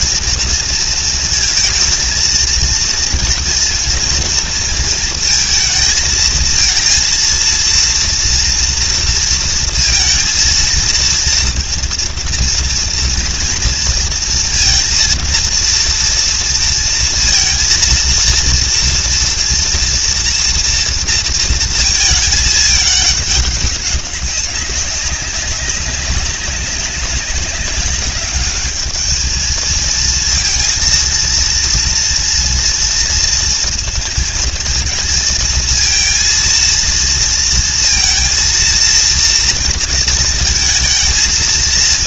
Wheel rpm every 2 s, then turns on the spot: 220, 230, 230, 230, 230, 230, 230, 230, 230, 230, 230, 210, 190, 190, 210, 230, 230, 230, 230, 230, 230.
none